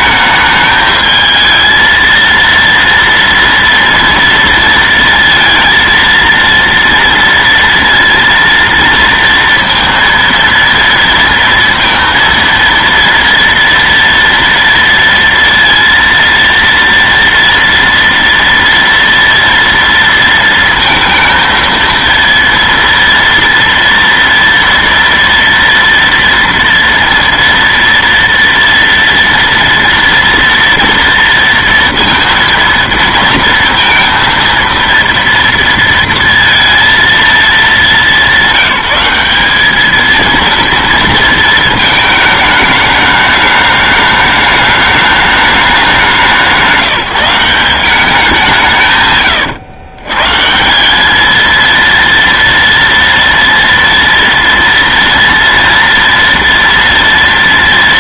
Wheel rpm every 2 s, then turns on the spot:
220, 230, 230, 230, 230, 230, 230, 230, 230, 230, 230, 230, 230, 240, 230, 230, 230, 230, 230, 200, 230, 220, 210, 190, 190, 130, 230, 240, 230.
none